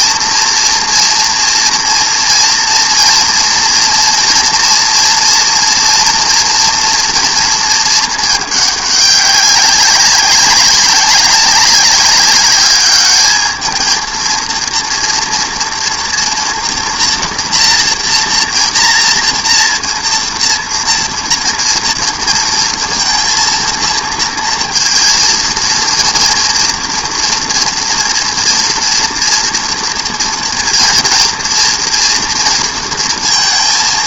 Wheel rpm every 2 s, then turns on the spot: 230, 230, 230, 240, 210, 200, 210, 230, 240, 230, 230, 230, 230, 230, 230, 230, 230.
none